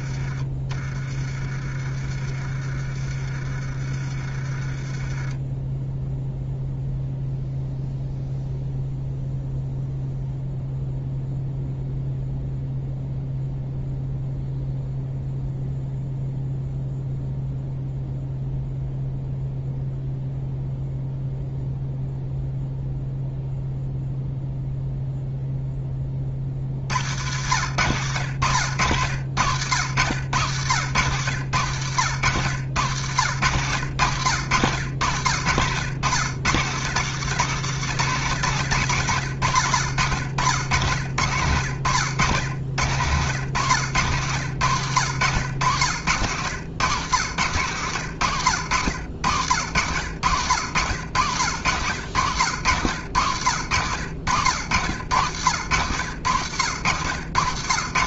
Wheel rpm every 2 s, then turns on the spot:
20, 30, 20, 0, 0, 0, 0, 0, 0, 0, 0, 0, 0, 70, 100, 100, 90, 90, 130, 90, 80, 90, 120, 110, 90, 90, 110, 100, 100.
none